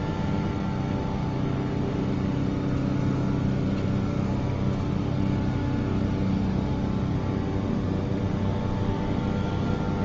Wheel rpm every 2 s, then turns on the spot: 0, 0, 0, 0, 0.
none